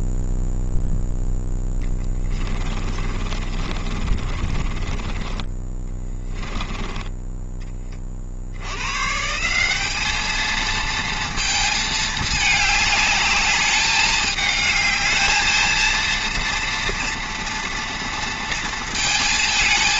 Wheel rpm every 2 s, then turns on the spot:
0, 30, 30, 10, 80, 220, 210, 210, 230, 230.
2-8